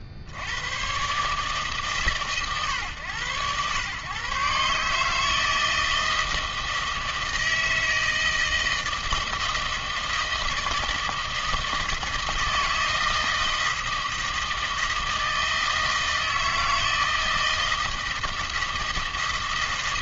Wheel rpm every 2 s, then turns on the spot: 70, 120, 140, 160, 160, 160, 160, 160, 160, 160.
none